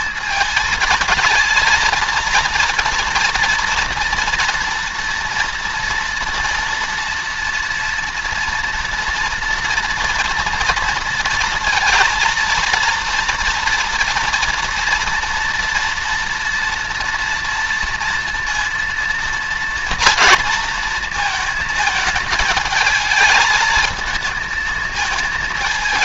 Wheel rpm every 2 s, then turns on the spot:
220, 230, 240, 230, 230, 230, 230, 230, 230, 230, 230, 210, 220.
none